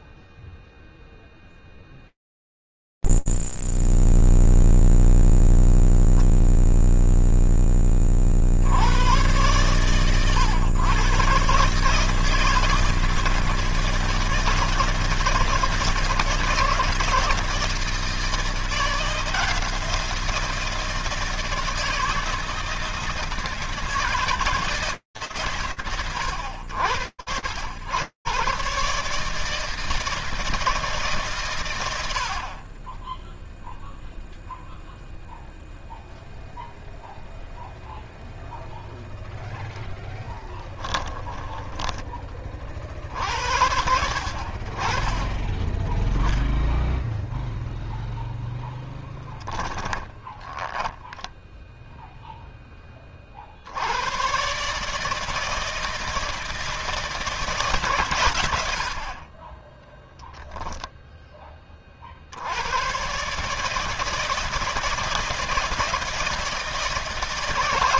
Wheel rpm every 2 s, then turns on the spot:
0, 0, 0, 0, 10, 120, 150, 160, 160, 160, 170, 160, 160, 90, 140, 140, 20, 0, 0, 0, 10, 50, 40, 0, 10, 10, 10, 140, 160, 60, 0, 100, 160, 160.
40-42 50-52